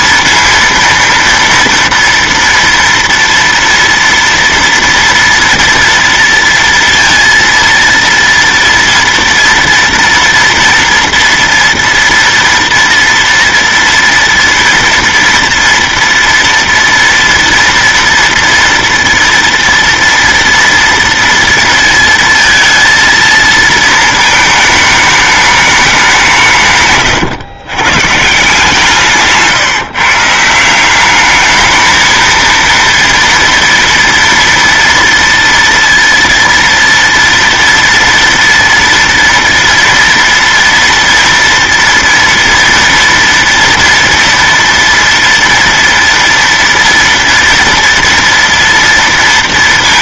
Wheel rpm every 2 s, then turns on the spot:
230, 230, 230, 230, 230, 230, 230, 230, 230, 240, 230, 230, 220, 150, 160, 170, 230, 230, 230, 230, 230, 230, 230, 230, 240.
none